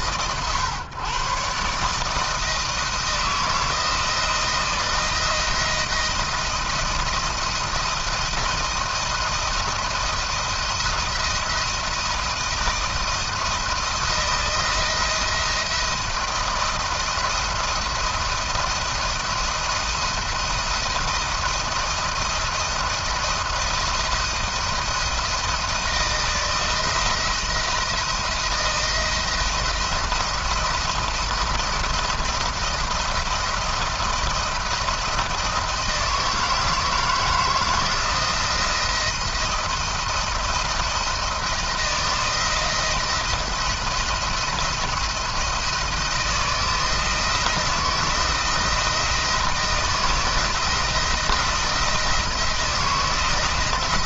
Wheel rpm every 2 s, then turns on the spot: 120, 160, 170, 170, 170, 170, 160, 170, 170, 170, 160, 160, 170, 170, 170, 170, 170, 170, 160, 170, 170, 170, 170, 170, 170, 160, 160.
none